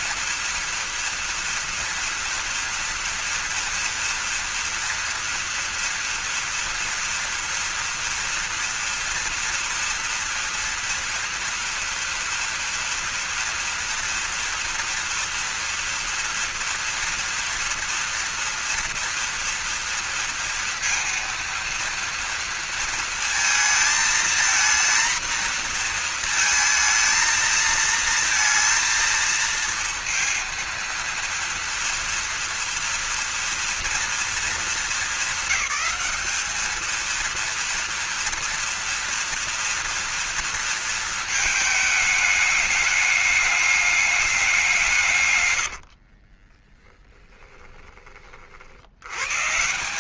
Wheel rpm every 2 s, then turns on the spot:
230, 230, 230, 230, 230, 240, 230, 230, 230, 230, 230, 230, 230, 220, 230, 230, 230, 220, 220, 230, 230, 210, 160, 10, 80.
46-48